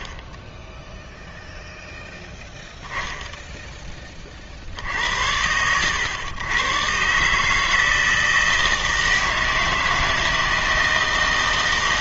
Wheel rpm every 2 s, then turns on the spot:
10, 0, 60, 120, 160, 160.
none